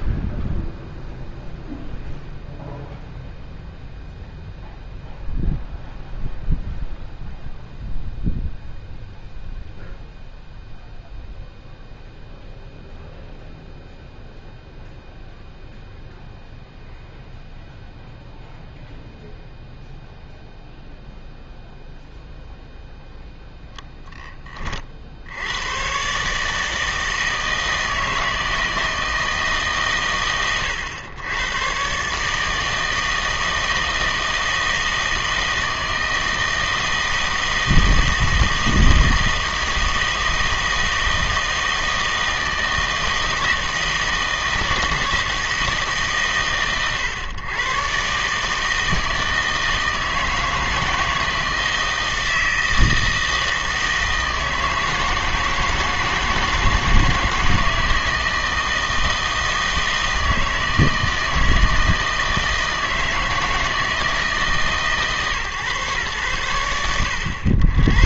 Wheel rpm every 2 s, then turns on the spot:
0, 0, 0, 0, 0, 0, 0, 0, 0, 0, 0, 0, 40, 160, 160, 100, 160, 160, 160, 160, 160, 160, 160, 120, 160, 160, 160, 160, 160, 160, 160, 160, 140, 70.
none